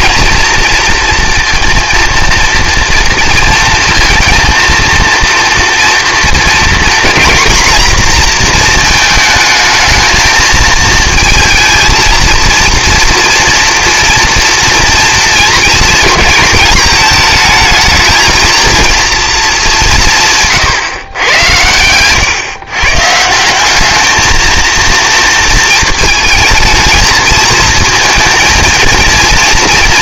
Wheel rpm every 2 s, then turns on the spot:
230, 230, 230, 230, 220, 220, 230, 230, 220, 230, 130, 140, 230, 220, 230.
none